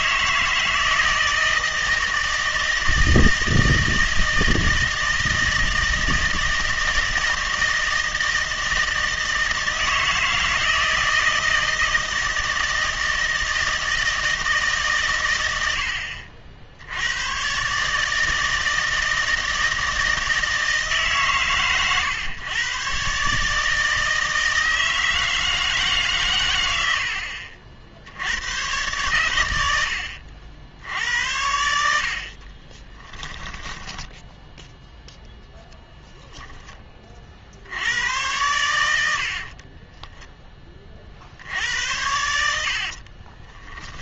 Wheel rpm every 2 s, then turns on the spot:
160, 160, 160, 160, 160, 160, 160, 150, 70, 160, 160, 130, 160, 90, 110, 70, 30, 0, 10, 100, 30, 70.
32-34 42-44